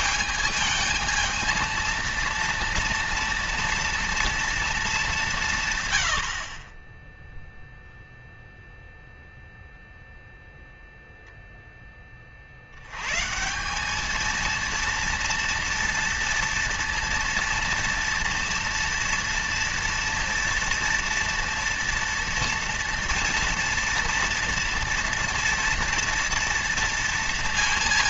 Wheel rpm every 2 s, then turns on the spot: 220, 230, 220, 40, 0, 0, 60, 230, 230, 230, 230, 230, 240, 230.
none